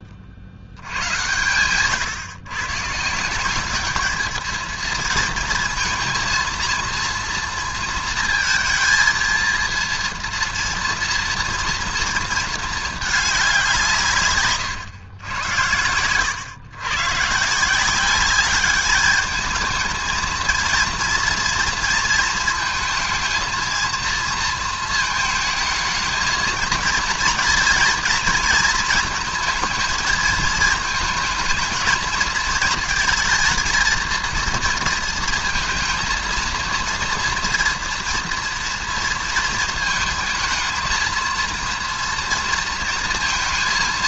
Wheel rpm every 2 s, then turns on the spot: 70, 120, 220, 230, 220, 230, 230, 130, 120, 200, 230, 230, 230, 230, 220, 220, 230, 230, 230, 230, 220, 230.
none